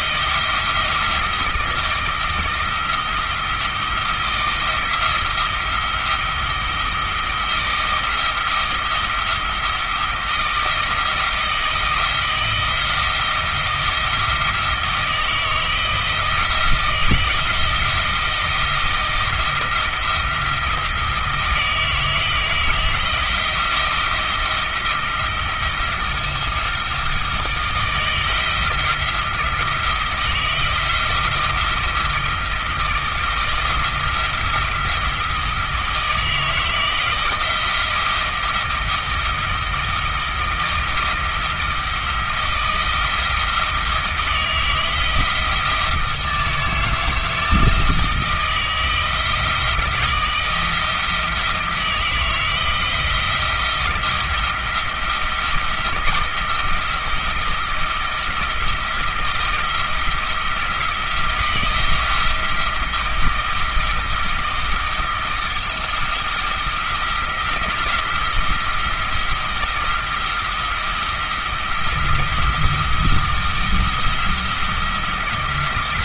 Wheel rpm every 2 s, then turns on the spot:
160, 170, 170, 170, 170, 170, 170, 160, 170, 170, 170, 160, 160, 170, 170, 160, 160, 160, 160, 160, 160, 160, 160, 160, 170, 170, 160, 170, 160, 160, 170, 170, 160, 170, 170, 170, 170, 170.
none